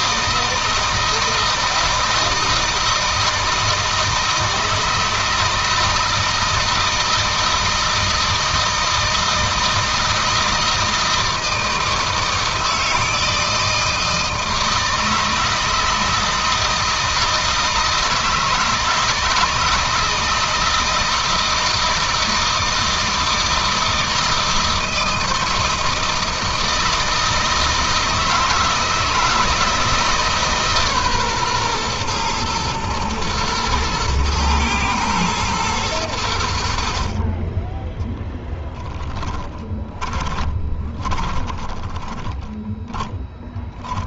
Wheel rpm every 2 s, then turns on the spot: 160, 160, 160, 160, 160, 160, 160, 160, 160, 160, 160, 160, 160, 160, 160, 140, 120, 110, 50, 20, 20, 20.
38-44